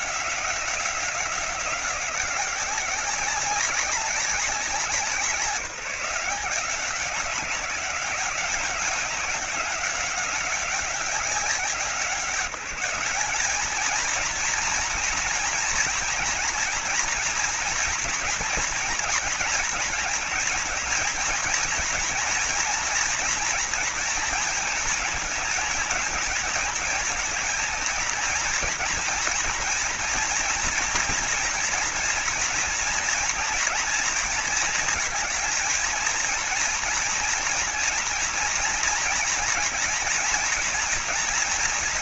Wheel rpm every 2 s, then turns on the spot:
180, 190, 190, 190, 190, 190, 190, 230, 230, 230, 220, 220, 220, 230, 230, 230, 230, 230, 230, 230, 230.
none